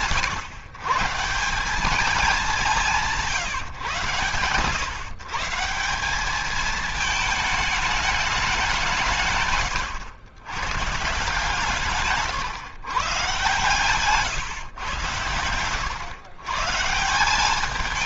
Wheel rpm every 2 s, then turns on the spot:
140, 180, 130, 220, 150, 130, 130, 120, 160.
none